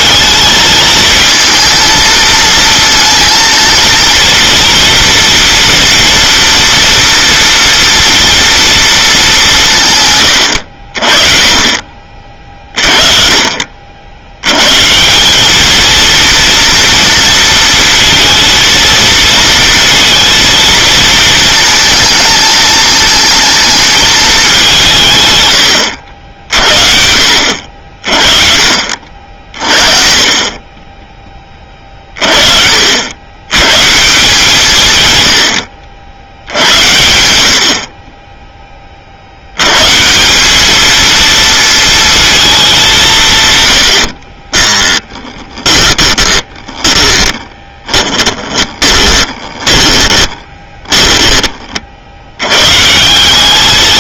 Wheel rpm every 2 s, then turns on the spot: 220, 230, 240, 230, 230, 80, 40, 110, 230, 230, 220, 220, 210, 60, 50, 20, 50, 150, 90, 20, 210, 200, 30, 20, 20, 20, 130.
44-52